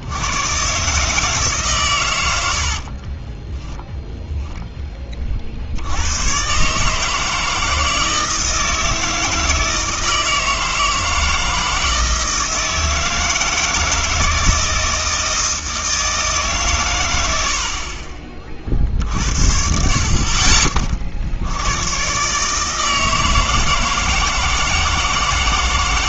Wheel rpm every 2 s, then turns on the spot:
120, 70, 10, 130, 160, 160, 160, 160, 130, 40, 40, 160, 160.
2-4